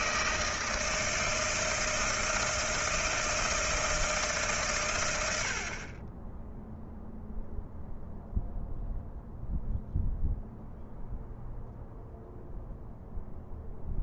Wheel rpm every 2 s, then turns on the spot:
160, 160, 130, 0, 0, 0, 0.
none